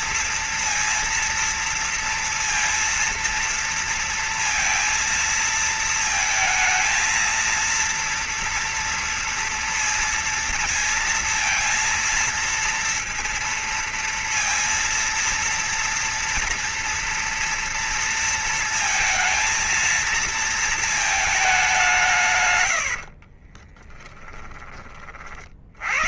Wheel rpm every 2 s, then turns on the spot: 230, 230, 230, 230, 230, 230, 230, 230, 230, 230, 220, 90, 40.
22-24